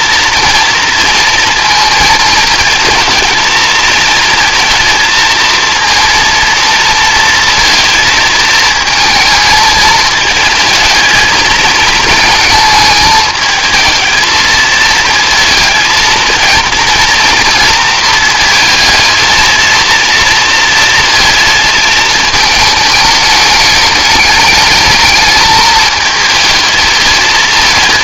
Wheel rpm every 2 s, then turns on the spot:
230, 220, 230, 230, 220, 220, 220, 220, 230, 230, 230, 210, 220, 220.
none